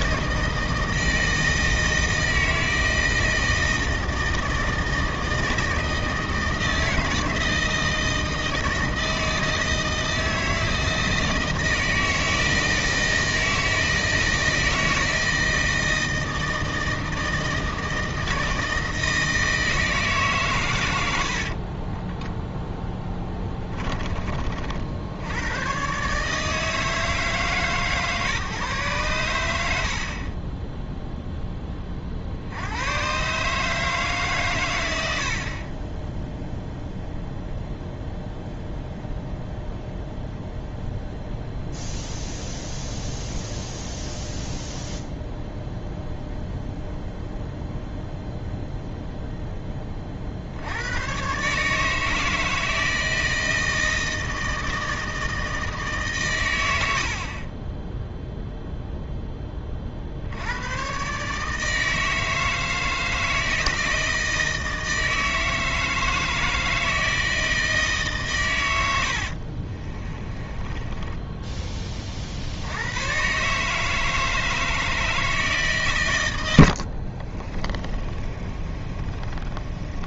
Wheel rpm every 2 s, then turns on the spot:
160, 160, 160, 160, 160, 160, 160, 160, 160, 160, 110, 10, 60, 160, 150, 20, 90, 110, 0, 0, 0, 0, 0, 0, 0, 80, 160, 160, 90, 0, 100, 160, 160, 160, 120, 20, 80, 160, 80, 30.
70-72 76-80